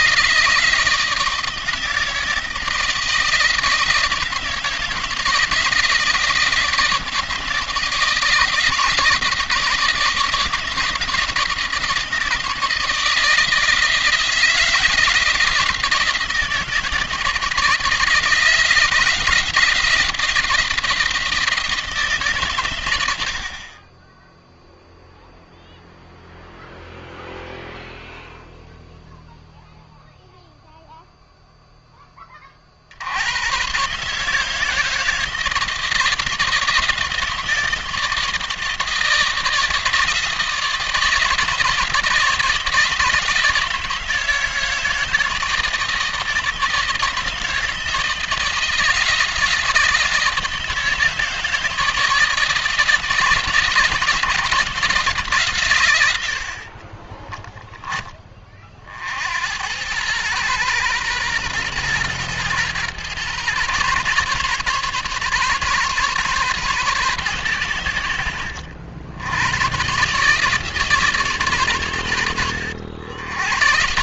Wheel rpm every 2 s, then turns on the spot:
160, 160, 160, 160, 160, 160, 160, 170, 170, 170, 170, 100, 0, 0, 0, 0, 70, 160, 160, 160, 160, 160, 160, 160, 160, 160, 160, 150, 20, 60, 120, 120, 140, 130, 90, 140, 90.
56-58